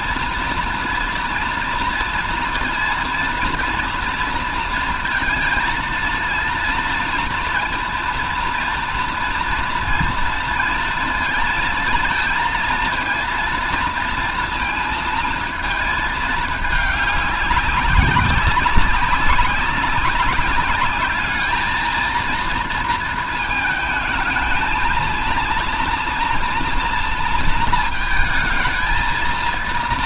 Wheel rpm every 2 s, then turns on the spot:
240, 230, 230, 230, 230, 230, 220, 230, 210, 190, 200, 230, 220, 240, 220.
none